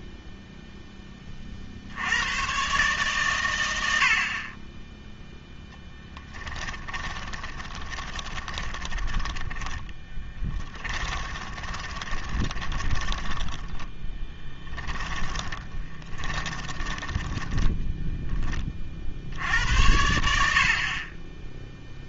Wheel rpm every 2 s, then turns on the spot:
0, 130, 30, 20, 20, 20, 30, 20, 20, 20, 70.
6-18